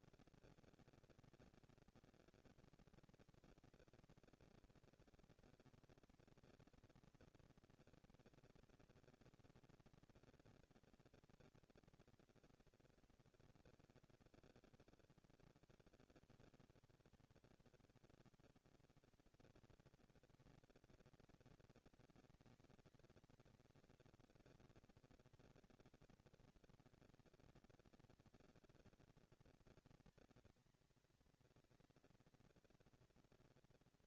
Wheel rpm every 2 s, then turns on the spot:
230, 230, 230, 230, 230, 230, 230, 170, 160, 180, 230, 230, 230, 230, 230, 220, 230.
none